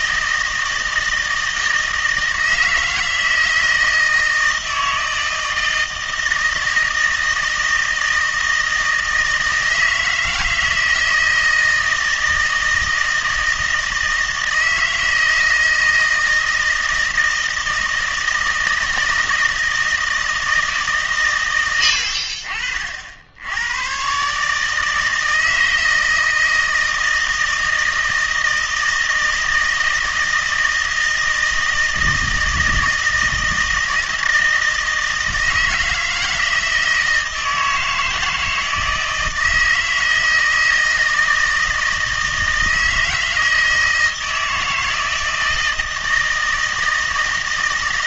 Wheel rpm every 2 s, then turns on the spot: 160, 160, 160, 160, 160, 160, 160, 160, 160, 160, 160, 60, 150, 160, 160, 160, 160, 160, 160, 160, 160, 160, 160, 160.
none